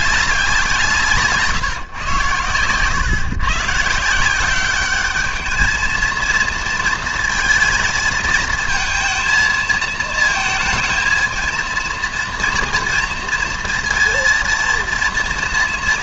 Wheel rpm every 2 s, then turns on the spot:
180, 120, 190, 230, 220, 220, 230, 230.
none